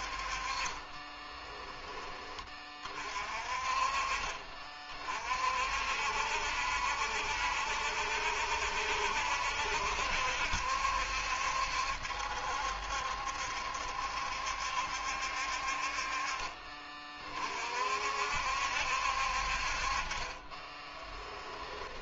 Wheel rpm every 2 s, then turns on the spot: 20, 30, 40, 70, 70, 70, 70, 70, 30, 60, 30.
0-2 20-22